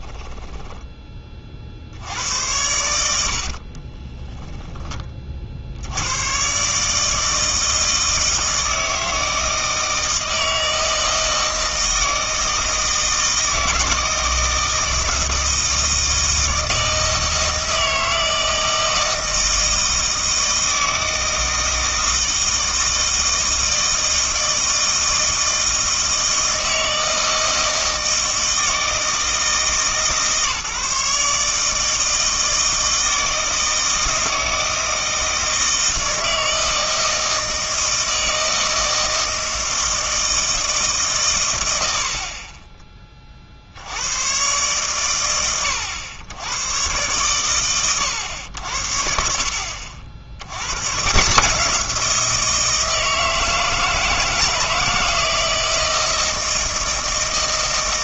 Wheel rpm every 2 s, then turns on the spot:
10, 90, 10, 130, 160, 160, 160, 160, 160, 160, 160, 160, 160, 160, 160, 150, 160, 160, 160, 160, 160, 30, 120, 100, 70, 110, 170, 160, 160.
none